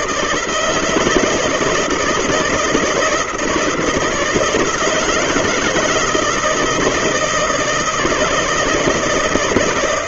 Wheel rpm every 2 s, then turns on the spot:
160, 160, 170, 160, 160.
none